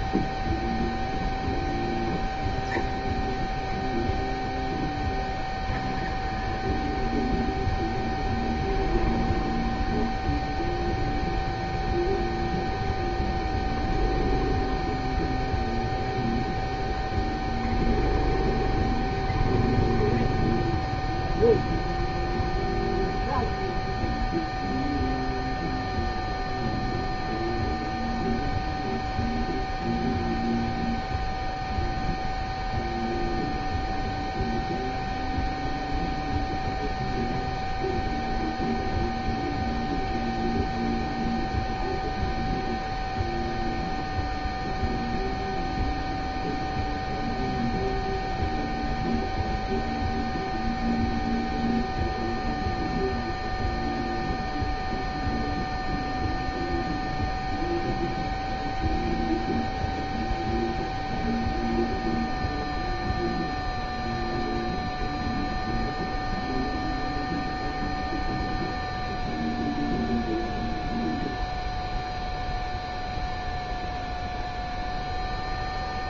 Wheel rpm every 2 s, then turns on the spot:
0, 0, 0, 0, 0, 0, 0, 0, 0, 0, 0, 0, 0, 0, 0, 0, 0, 0, 0, 0, 0, 0, 0, 0, 0, 0, 0, 0, 0, 0, 0, 0, 0, 0, 0, 0, 0, 0.
none